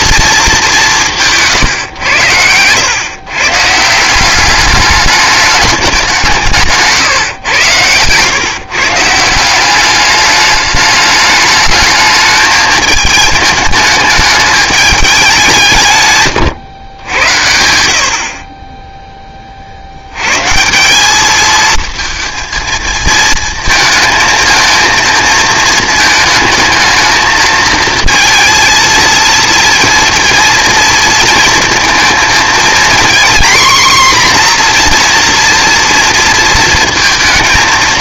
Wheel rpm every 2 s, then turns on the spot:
200, 110, 210, 150, 150, 210, 220, 210, 110, 20, 160, 230, 230, 220, 230, 230, 230, 250, 230.
none